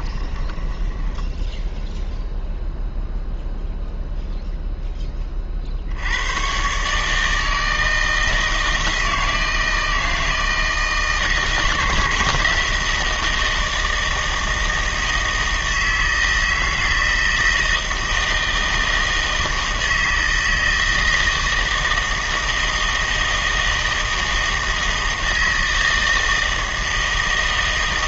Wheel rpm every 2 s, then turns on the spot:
10, 0, 10, 130, 160, 160, 160, 160, 160, 160, 160, 160, 160, 160.
0-2